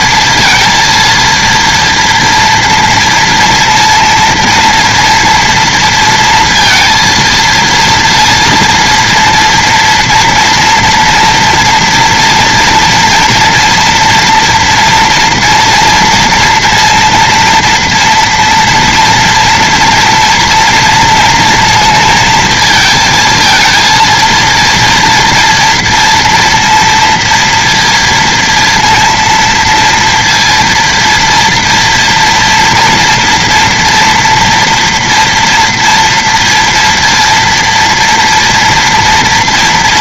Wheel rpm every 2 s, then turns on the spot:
230, 230, 230, 230, 230, 230, 240, 230, 230, 230, 230, 220, 230, 230, 230, 230, 230, 230, 230, 230.
none